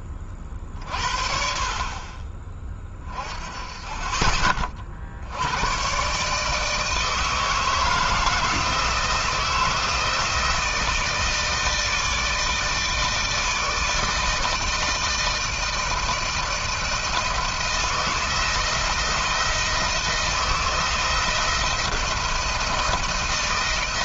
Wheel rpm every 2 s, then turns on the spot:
40, 30, 40, 150, 160, 160, 160, 160, 160, 170, 160, 160.
none